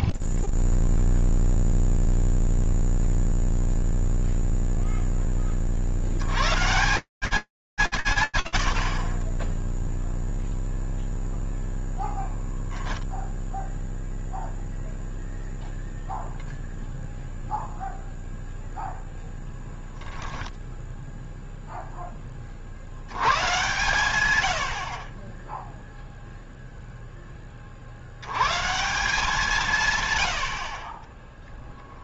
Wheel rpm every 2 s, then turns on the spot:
0, 0, 0, 50, 30, 0, 0, 0, 0, 0, 0, 110, 40, 10, 170, 30.
none